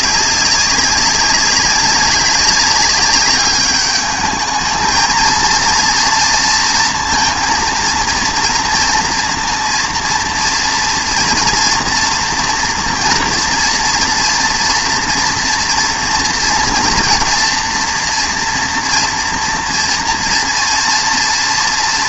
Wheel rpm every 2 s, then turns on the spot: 200, 200, 220, 230, 230, 230, 230, 230, 230, 230, 230.
none